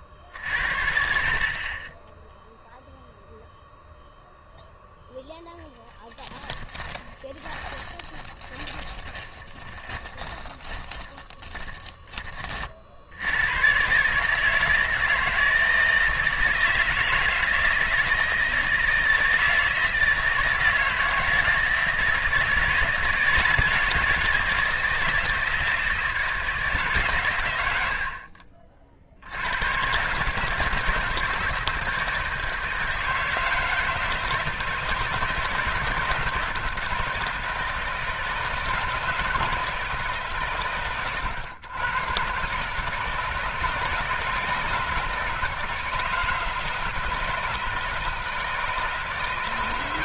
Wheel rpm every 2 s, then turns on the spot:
50, 0, 0, 10, 20, 30, 40, 160, 160, 160, 160, 160, 170, 160, 50, 160, 160, 160, 160, 160, 130, 140, 170, 160, 160.
6-12